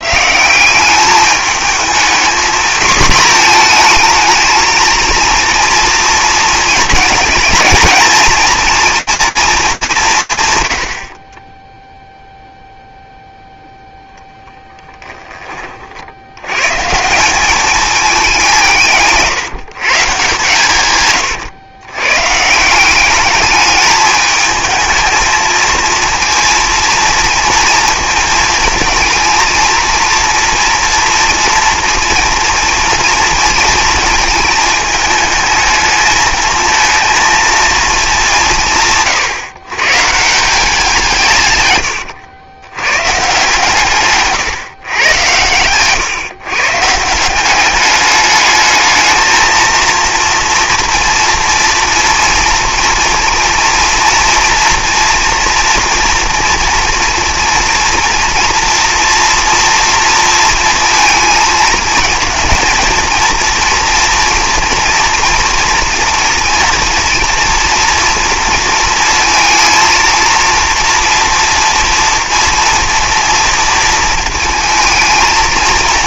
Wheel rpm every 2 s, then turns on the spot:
180, 230, 220, 220, 230, 120, 0, 10, 140, 160, 130, 190, 220, 230, 220, 230, 230, 220, 230, 160, 170, 140, 130, 160, 220, 230, 230, 230, 230, 240, 230, 240, 230, 230, 230, 240, 230, 220.
14-16